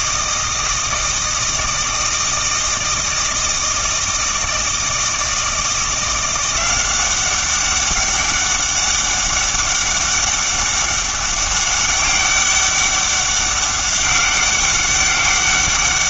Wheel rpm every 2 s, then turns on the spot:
160, 160, 160, 180, 200, 200, 200, 200.
none